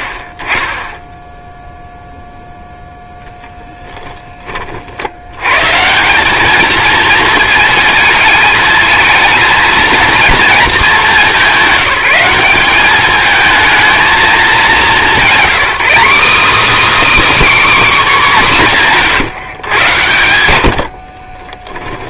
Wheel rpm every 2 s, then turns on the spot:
20, 0, 30, 230, 220, 220, 200, 210, 300, 220, 60.
20-22